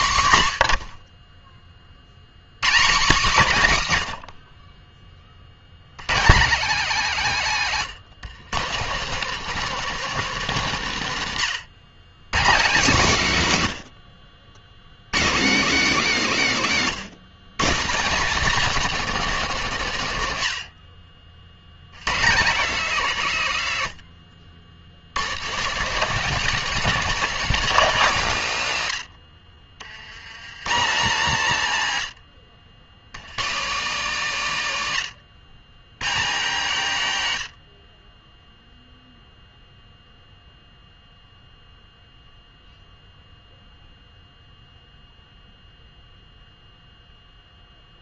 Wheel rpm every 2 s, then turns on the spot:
110, 150, 30, 190, 170, 190, 140, 80, 170, 250, 90, 170, 100, 240, 150, 150, 90, 150, 150, 0, 0, 0, 0, 0.
none